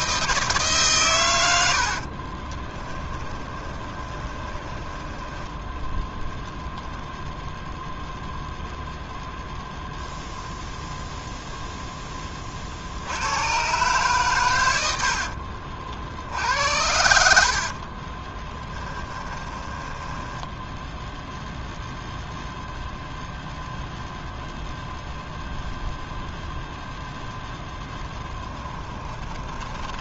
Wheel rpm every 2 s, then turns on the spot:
130, 10, 10, 0, 0, 0, 70, 80, 70, 30, 0, 0, 0, 0, 20.
2-6 14-16 18-20 28-30